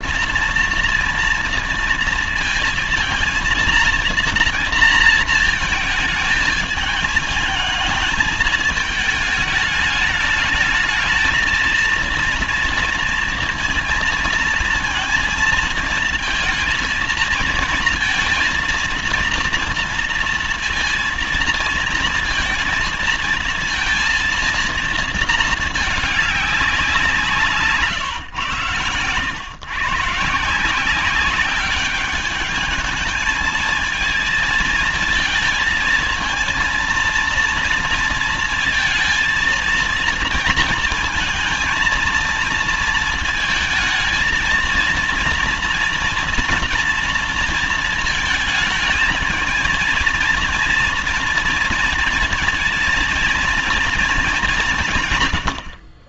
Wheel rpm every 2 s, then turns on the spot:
230, 230, 230, 220, 220, 220, 230, 230, 230, 230, 230, 230, 230, 190, 120, 170, 210, 230, 230, 230, 230, 230, 230, 230, 230, 230, 230, 170.
none